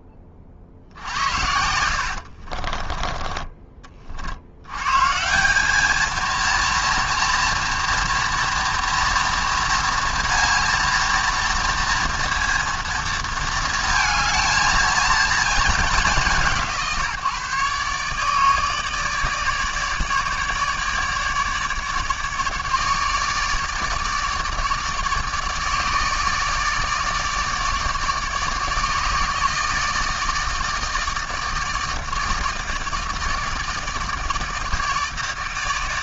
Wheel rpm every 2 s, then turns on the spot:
50, 40, 100, 230, 230, 230, 230, 220, 170, 150, 150, 150, 150, 150, 150, 160, 160, 160.
2-4